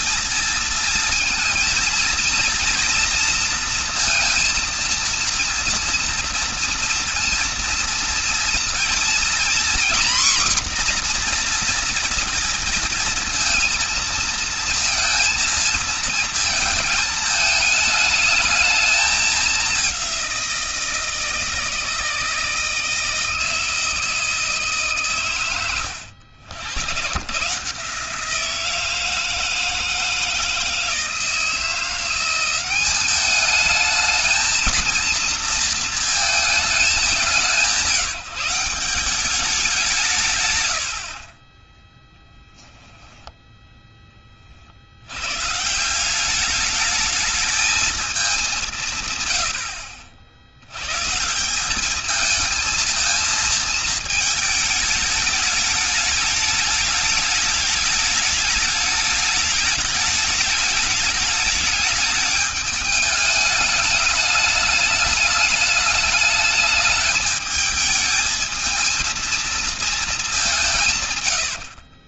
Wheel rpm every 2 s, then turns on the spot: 230, 230, 230, 230, 230, 250, 230, 230, 220, 210, 170, 160, 150, 100, 160, 160, 190, 230, 210, 170, 120, 10, 50, 200, 170, 110, 220, 220, 210, 210, 210, 210, 210, 220, 220, 160.
none